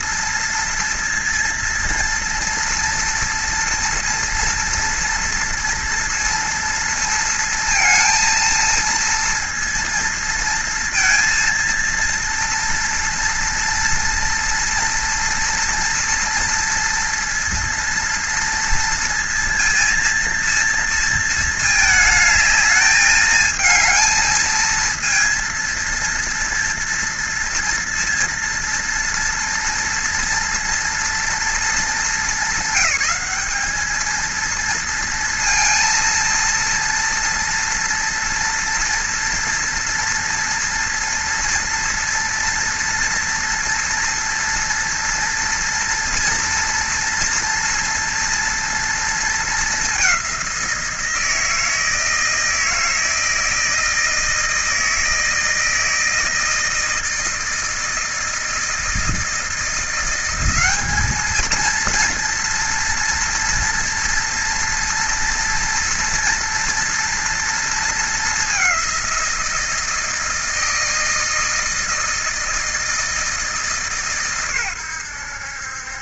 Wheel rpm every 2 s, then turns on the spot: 230, 230, 240, 230, 230, 230, 230, 230, 230, 230, 230, 220, 220, 230, 230, 230, 210, 230, 230, 230, 240, 230, 230, 230, 230, 190, 160, 160, 160, 160, 190, 230, 230, 230, 200, 160, 160, 120.
none